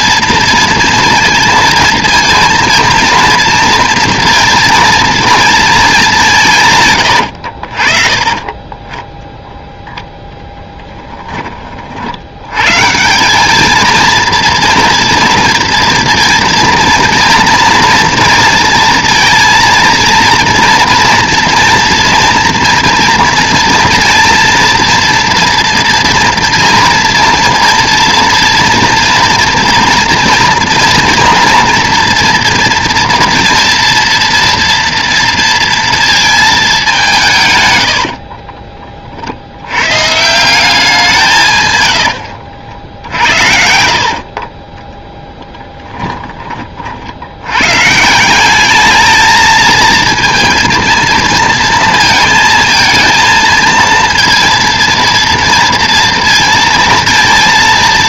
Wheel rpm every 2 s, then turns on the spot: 230, 230, 230, 140, 20, 10, 120, 230, 230, 230, 230, 240, 240, 230, 230, 230, 230, 240, 210, 30, 180, 70, 20, 40, 200, 230, 230, 230, 230.
42-46